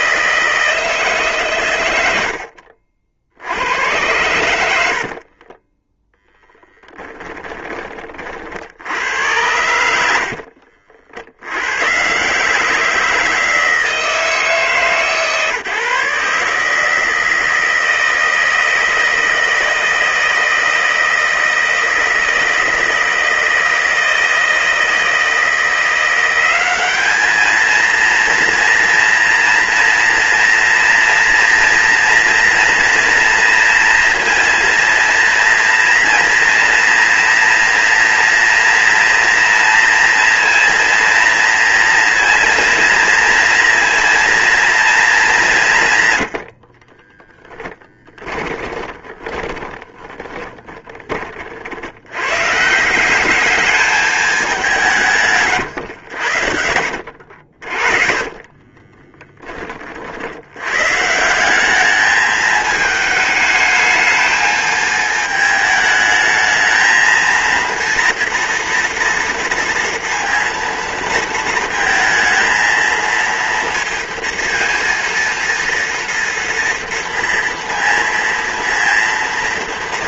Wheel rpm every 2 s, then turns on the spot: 160, 60, 60, 10, 80, 60, 170, 150, 150, 160, 160, 160, 160, 200, 230, 230, 230, 230, 230, 230, 230, 230, 220, 30, 30, 20, 170, 160, 80, 30, 150, 220, 220, 220, 230, 230, 230, 230, 230, 230.
4-8 46-50 56-60